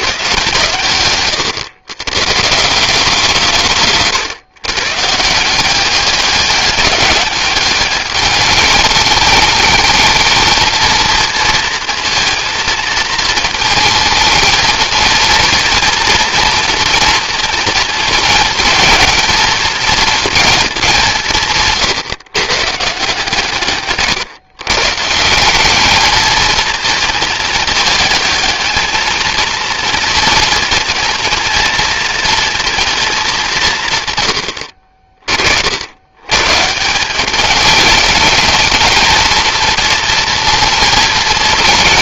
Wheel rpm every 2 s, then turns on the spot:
130, 160, 130, 200, 210, 220, 230, 220, 230, 230, 220, 140, 130, 220, 220, 230, 230, 80, 140, 220, 230.
none